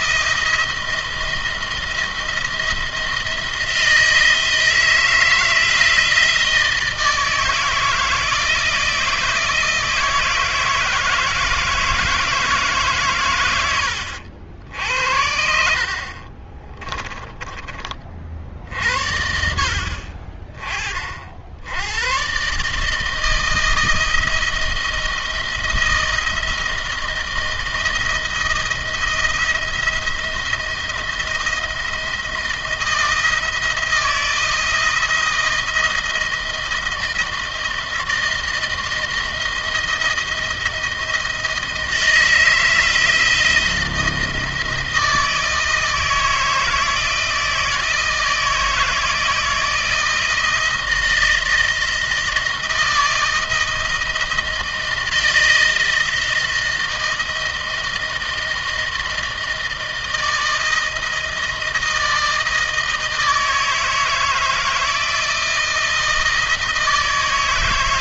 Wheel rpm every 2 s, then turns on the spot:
170, 170, 160, 160, 170, 160, 140, 70, 20, 60, 40, 160, 160, 160, 160, 170, 170, 170, 170, 160, 160, 160, 160, 160, 160, 160, 170, 160, 160, 160, 160, 160, 160, 160.
16-18